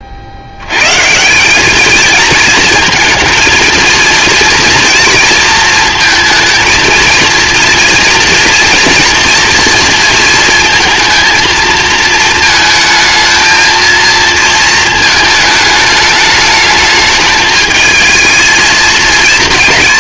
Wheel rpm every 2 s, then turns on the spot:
130, 230, 230, 230, 230, 230, 230, 220, 210, 230.
none